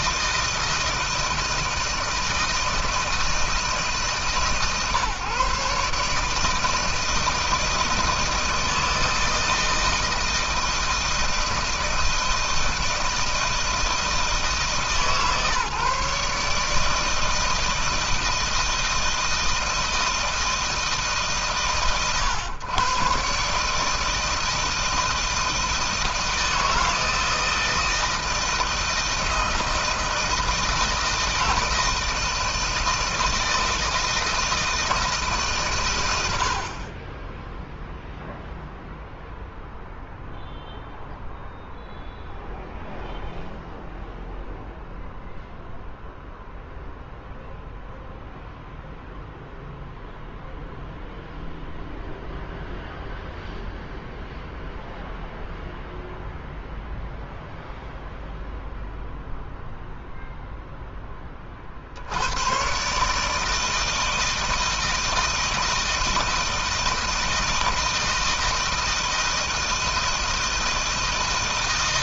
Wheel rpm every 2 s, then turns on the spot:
160, 160, 140, 160, 160, 160, 160, 150, 160, 160, 150, 130, 160, 160, 170, 160, 160, 160, 30, 0, 0, 0, 0, 0, 0, 0, 0, 0, 0, 0, 10, 140, 160, 160, 160, 160.
none